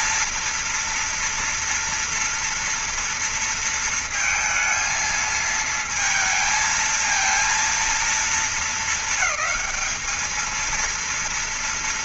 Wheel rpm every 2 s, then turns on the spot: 230, 230, 220, 220, 230, 220.
none